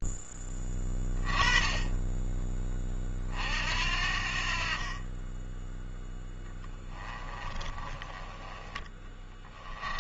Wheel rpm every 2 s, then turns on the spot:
20, 20, 40, 20, 20.
6-8